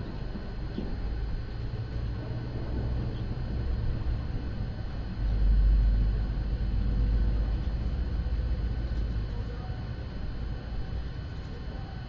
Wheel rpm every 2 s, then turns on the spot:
0, 0, 0, 0, 0, 0.
none